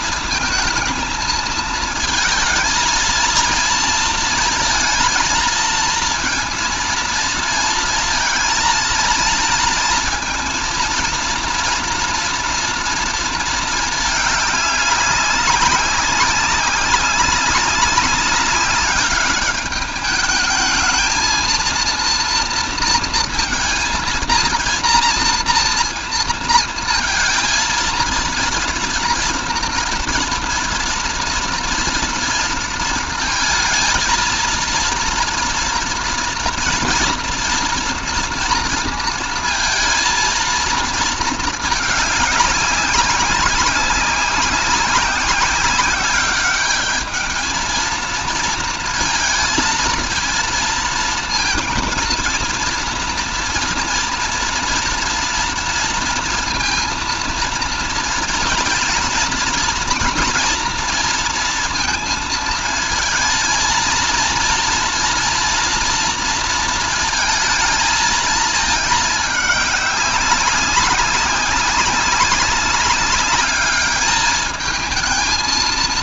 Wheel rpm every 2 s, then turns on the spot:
230, 230, 230, 230, 230, 240, 230, 200, 190, 200, 220, 230, 230, 230, 230, 240, 230, 230, 240, 230, 230, 200, 190, 210, 230, 230, 230, 230, 230, 230, 230, 230, 230, 220, 210, 200, 200, 220.
none